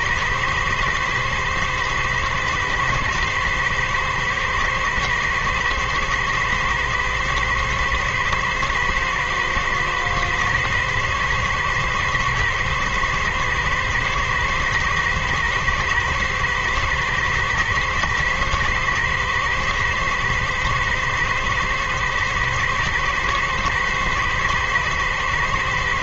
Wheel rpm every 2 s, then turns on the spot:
110, 110, 110, 110, 110, 110, 110, 110, 120, 110, 110, 110, 110.
none